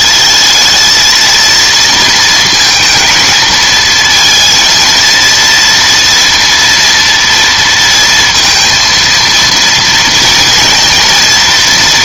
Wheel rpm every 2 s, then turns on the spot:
220, 220, 230, 230, 230, 230.
none